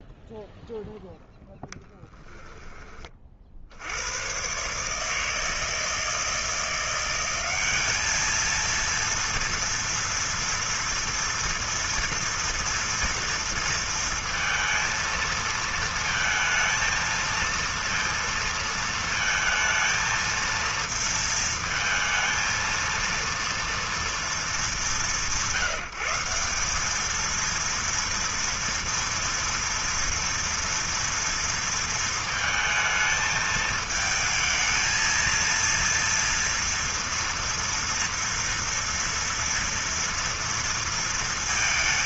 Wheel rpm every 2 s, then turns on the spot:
0, 20, 150, 180, 230, 230, 230, 220, 230, 220, 230, 230, 180, 210, 230, 230, 220, 220, 230, 230, 230.
none